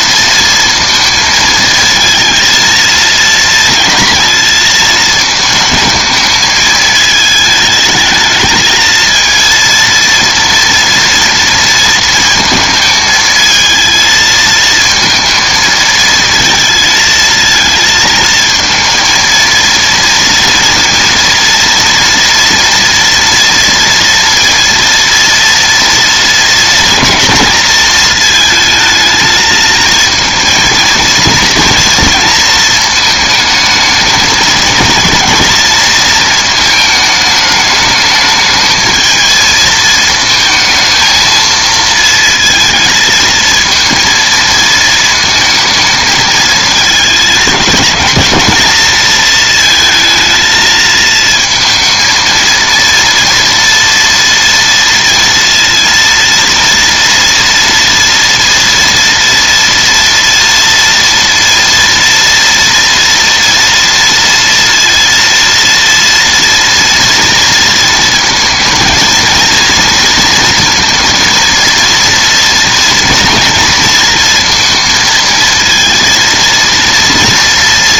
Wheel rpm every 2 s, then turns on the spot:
230, 230, 220, 220, 220, 230, 220, 220, 220, 220, 230, 230, 230, 230, 220, 230, 220, 230, 220, 220, 220, 230, 230, 220, 220, 220, 230, 230, 230, 230, 230, 230, 230, 230, 220, 230, 230, 230, 230.
none